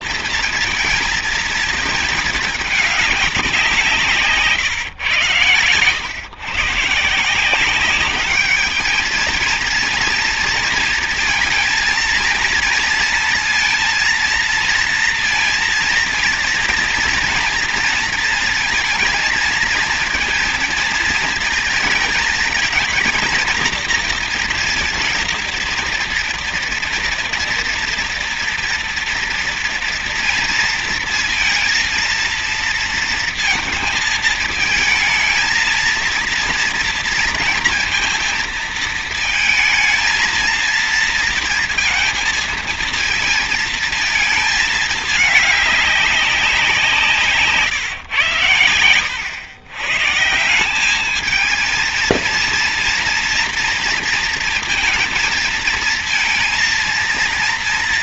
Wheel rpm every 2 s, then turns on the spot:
230, 210, 130, 160, 220, 230, 230, 230, 240, 230, 230, 230, 230, 230, 240, 230, 230, 220, 230, 230, 230, 230, 210, 180, 110, 200, 230, 230, 230.
none